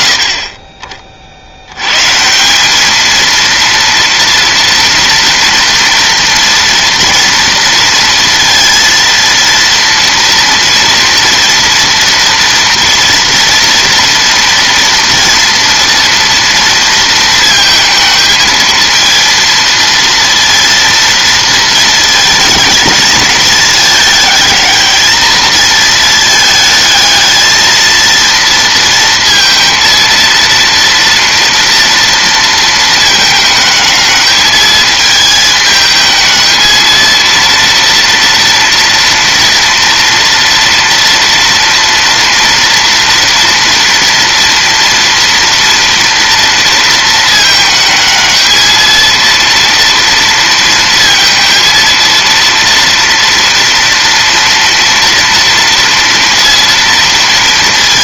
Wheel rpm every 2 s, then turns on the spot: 50, 220, 230, 230, 230, 230, 240, 230, 230, 230, 230, 220, 220, 220, 230, 240, 220, 220, 230, 230, 230, 230, 230, 220, 230, 230, 230, 230, 230.
none